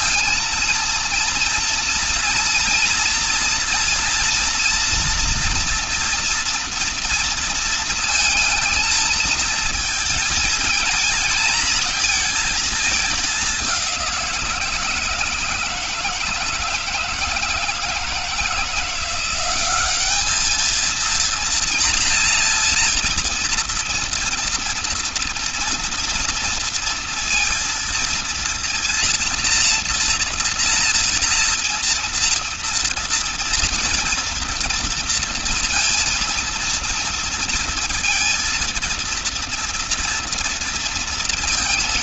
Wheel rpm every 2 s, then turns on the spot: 230, 230, 230, 230, 220, 230, 220, 170, 160, 170, 220, 230, 230, 230, 230, 230, 230, 230, 230, 230, 230.
none